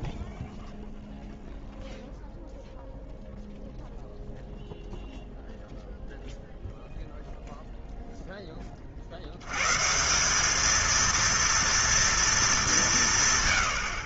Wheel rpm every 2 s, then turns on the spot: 0, 0, 0, 30, 210, 200, 60.
none